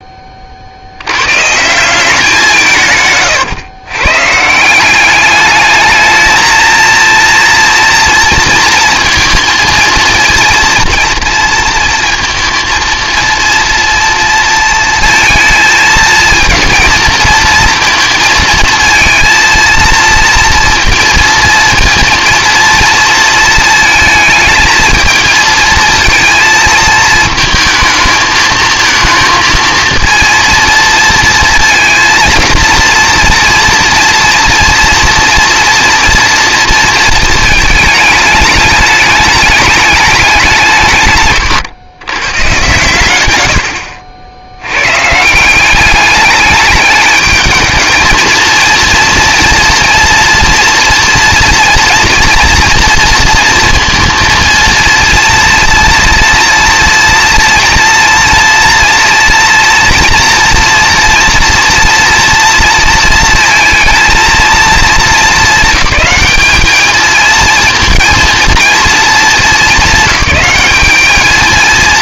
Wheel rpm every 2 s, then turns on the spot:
50, 160, 170, 220, 230, 230, 230, 230, 230, 230, 230, 230, 220, 220, 220, 230, 230, 240, 230, 210, 160, 110, 90, 210, 230, 230, 230, 230, 230, 230, 230, 230, 220, 210, 230, 210.
none